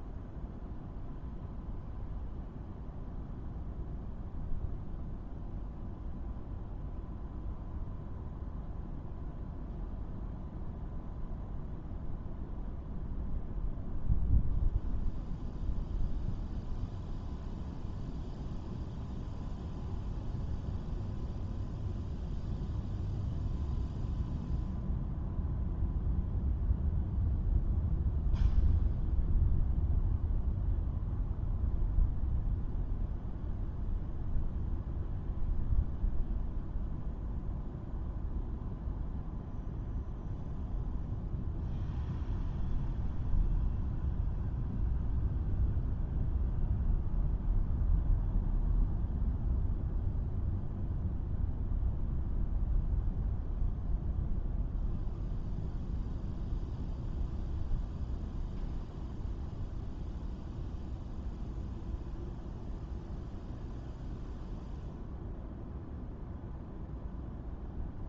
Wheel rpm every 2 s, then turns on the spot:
0, 0, 0, 0, 0, 0, 0, 0, 0, 0, 0, 0, 0, 0, 0, 0, 0, 0, 0, 0, 0, 0, 0, 0, 0, 0, 0, 0, 0, 0, 0, 0, 0, 0.
none